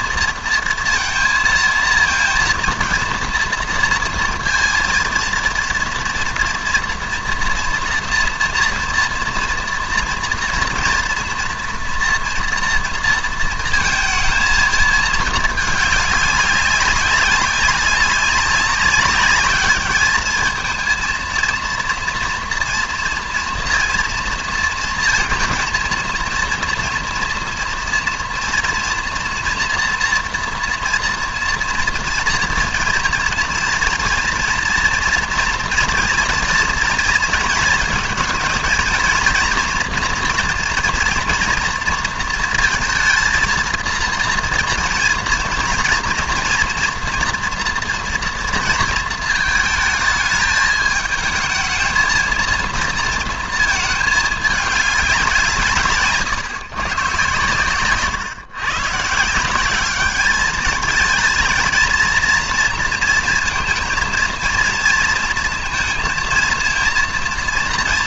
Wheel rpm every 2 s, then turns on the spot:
230, 230, 230, 230, 230, 230, 230, 230, 200, 200, 220, 230, 230, 230, 230, 230, 240, 230, 230, 230, 240, 230, 230, 240, 230, 220, 230, 210, 130, 130, 210, 230, 230, 230.
none